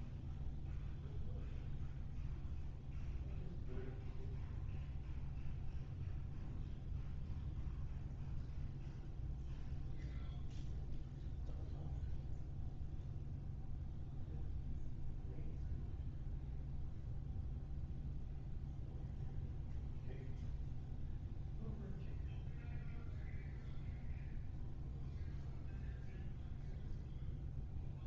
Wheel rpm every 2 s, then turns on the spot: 0, 0, 0, 0, 0, 0, 0, 0, 0, 0, 0, 0, 0, 0.
none